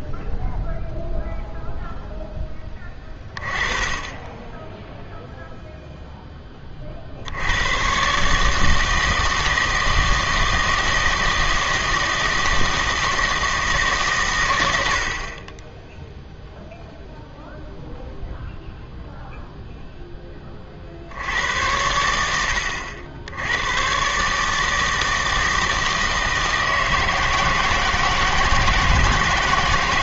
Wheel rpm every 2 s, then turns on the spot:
0, 10, 10, 30, 160, 160, 160, 100, 0, 0, 40, 80, 160, 160, 160.
none